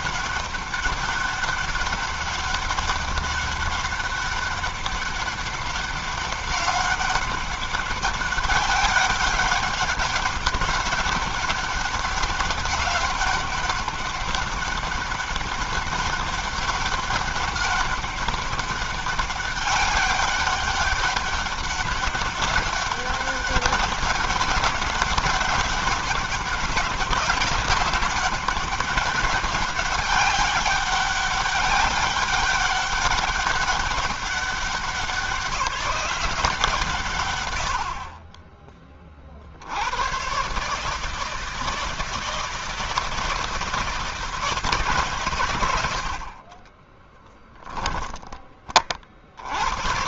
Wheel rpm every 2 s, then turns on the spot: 200, 200, 200, 200, 200, 200, 200, 200, 200, 200, 190, 200, 200, 200, 200, 200, 200, 190, 160, 30, 150, 160, 140, 10, 20.
46-48